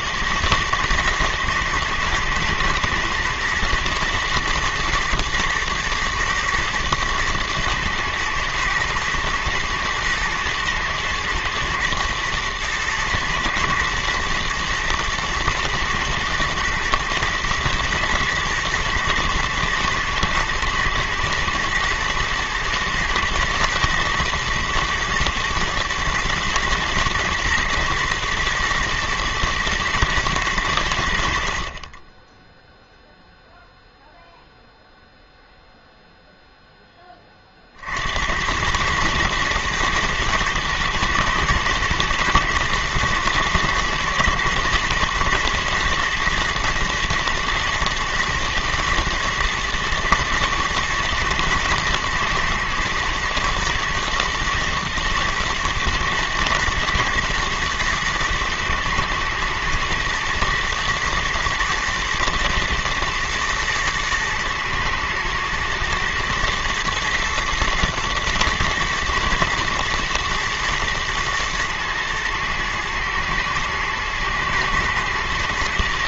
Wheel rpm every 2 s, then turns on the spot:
110, 120, 120, 110, 120, 120, 110, 120, 110, 110, 110, 110, 110, 110, 110, 100, 0, 0, 0, 90, 120, 120, 120, 110, 120, 110, 110, 120, 110, 110, 110, 120, 120, 110, 110, 120, 110, 110.
none